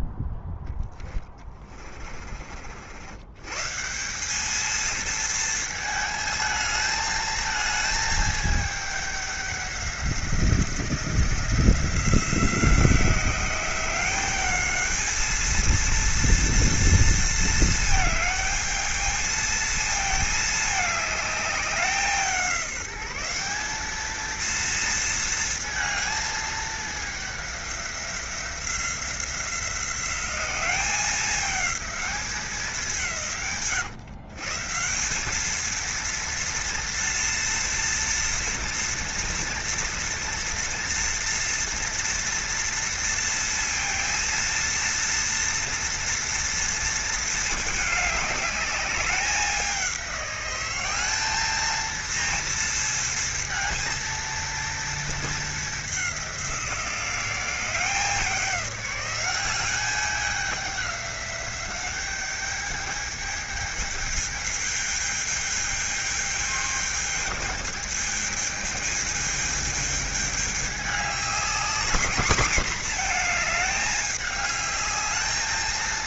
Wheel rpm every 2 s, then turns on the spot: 10, 80, 220, 220, 210, 170, 180, 220, 230, 220, 210, 190, 230, 210, 180, 200, 170, 180, 230, 230, 230, 230, 230, 220, 200, 200, 220, 220, 180, 190, 190, 210, 220, 210, 220, 210, 230, 210.
0-2